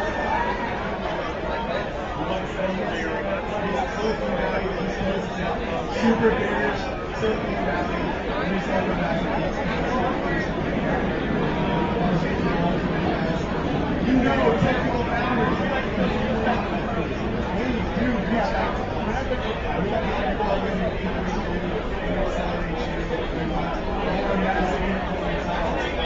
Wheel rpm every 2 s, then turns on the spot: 0, 0, 0, 0, 0, 0, 0, 0, 0, 0, 0, 0, 0.
none